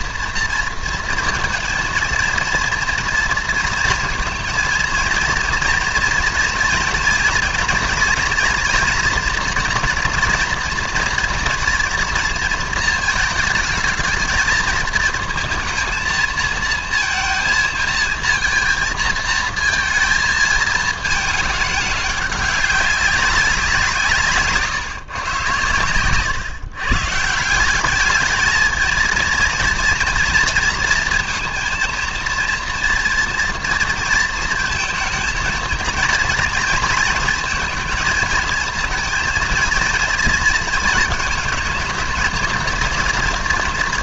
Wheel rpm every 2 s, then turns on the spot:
230, 230, 220, 230, 240, 230, 230, 220, 230, 230, 220, 200, 130, 130, 220, 230, 240, 230, 230, 230, 230, 230.
none